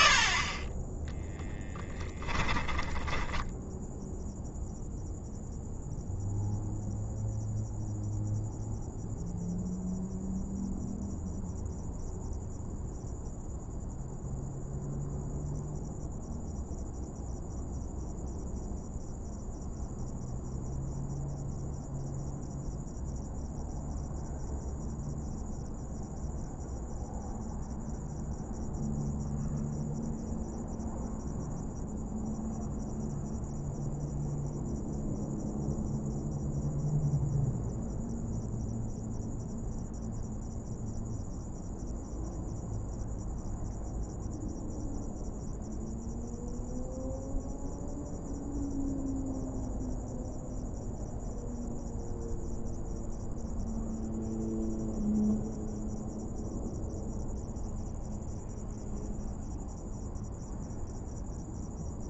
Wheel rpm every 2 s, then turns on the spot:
10, 10, 0, 0, 0, 0, 0, 0, 0, 0, 0, 0, 0, 0, 0, 0, 0, 0, 0, 0, 0, 0, 0, 0, 0, 0, 0, 0, 0, 0, 0.
2-4